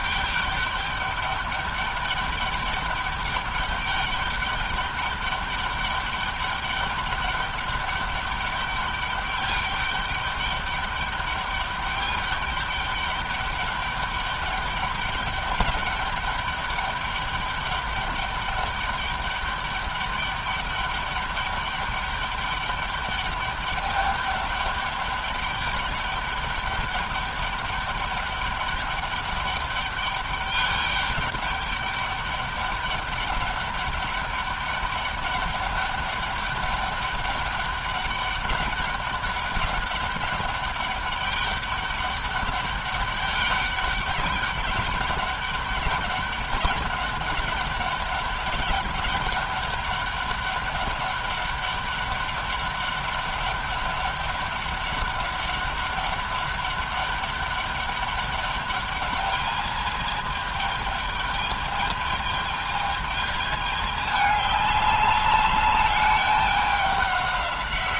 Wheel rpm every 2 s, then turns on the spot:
200, 200, 210, 200, 200, 200, 200, 200, 200, 200, 200, 210, 200, 200, 200, 200, 200, 200, 200, 200, 200, 200, 200, 200, 200, 200, 200, 200, 200, 210, 210, 220, 200, 200.
none